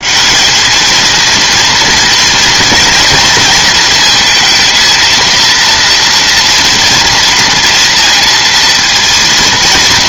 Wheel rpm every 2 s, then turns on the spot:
210, 230, 220, 230, 230.
none